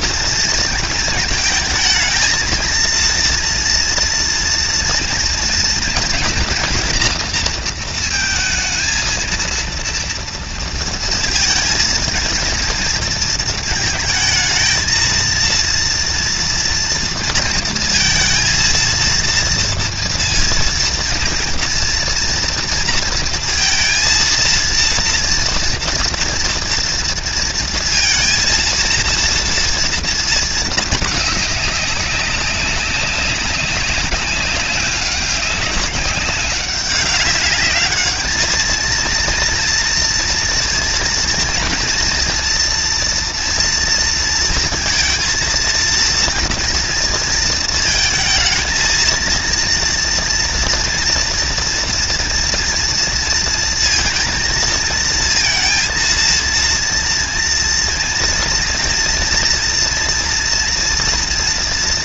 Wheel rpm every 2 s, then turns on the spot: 230, 220, 230, 240, 230, 230, 230, 220, 230, 230, 230, 230, 230, 230, 230, 230, 210, 190, 190, 200, 230, 230, 230, 230, 230, 230, 240, 230, 230, 240, 230.
none